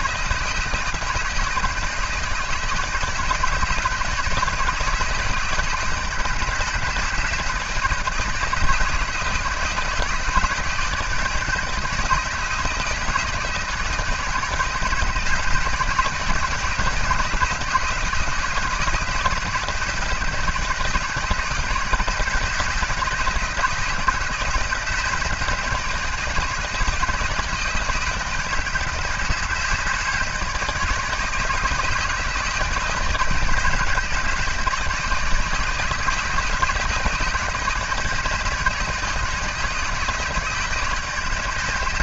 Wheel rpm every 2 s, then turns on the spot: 160, 160, 160, 150, 160, 160, 160, 160, 160, 160, 160, 160, 160, 160, 160, 160, 160, 160, 160, 160, 160.
none